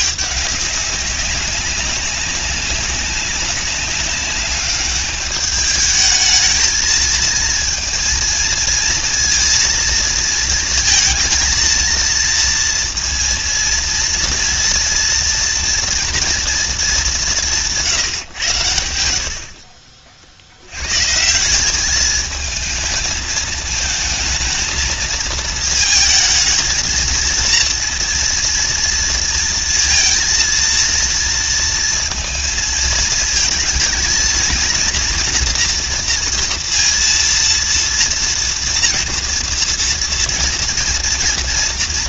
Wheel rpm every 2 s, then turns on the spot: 200, 190, 200, 220, 230, 230, 230, 230, 230, 100, 80, 220, 220, 230, 230, 230, 230, 230, 230, 230, 230.
none